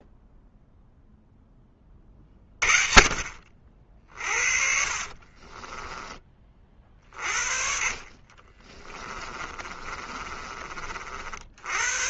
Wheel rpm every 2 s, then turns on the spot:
0, 40, 50, 30, 30, 40.
4-6 8-10